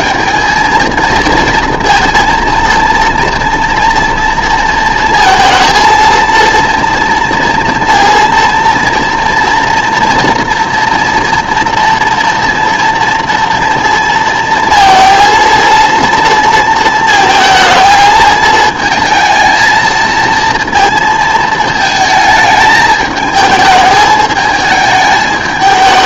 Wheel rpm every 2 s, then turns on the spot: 220, 230, 230, 230, 230, 230, 230, 230, 230, 220, 230, 220, 220.
none